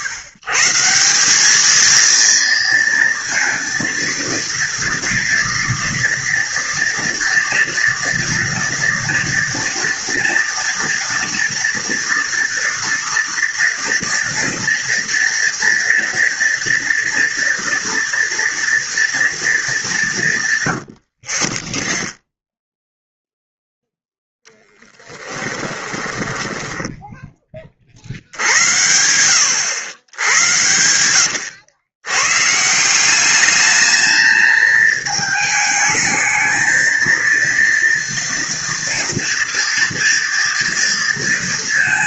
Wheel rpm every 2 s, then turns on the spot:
150, 230, 230, 230, 230, 230, 230, 230, 230, 230, 140, 0, 0, 10, 80, 90, 140, 220, 220, 230, 230.
26-28 30-32